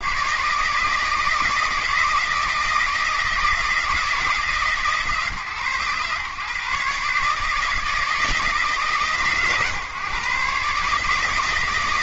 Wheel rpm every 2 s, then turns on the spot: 150, 160, 150, 140, 150, 140.
none